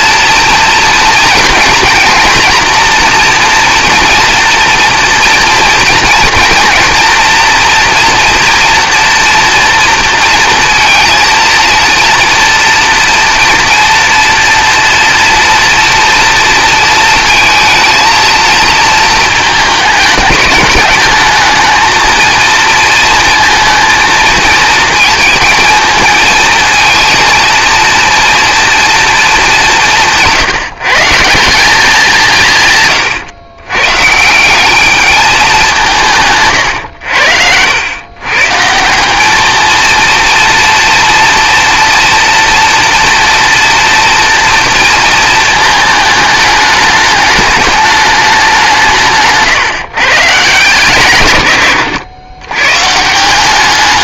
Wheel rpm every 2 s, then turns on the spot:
230, 240, 240, 230, 230, 230, 230, 230, 230, 220, 210, 230, 220, 220, 230, 150, 130, 210, 110, 170, 230, 230, 230, 210, 170, 140, 140.
48-50